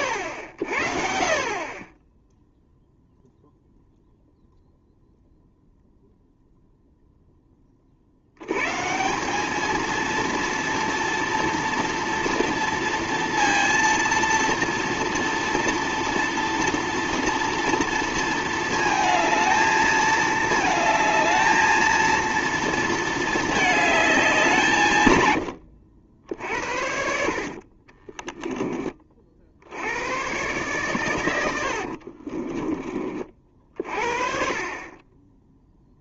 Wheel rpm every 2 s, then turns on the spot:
70, 0, 0, 0, 140, 230, 230, 230, 240, 220, 220, 230, 160, 60, 20, 120, 20, 30.
32-34